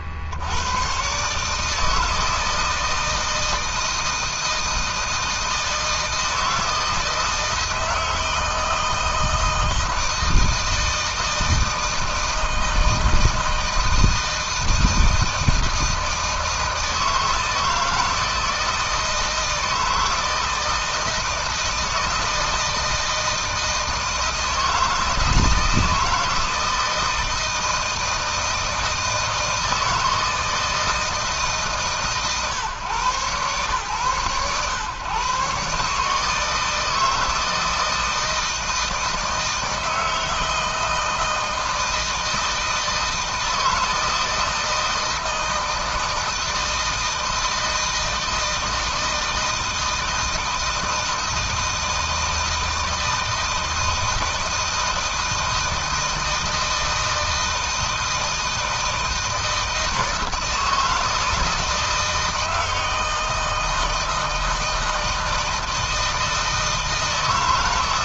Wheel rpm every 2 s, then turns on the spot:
130, 160, 160, 160, 160, 160, 160, 160, 160, 160, 160, 160, 160, 160, 160, 160, 130, 130, 160, 160, 160, 160, 160, 160, 160, 160, 160, 160, 160, 160, 160, 160, 160, 160.
none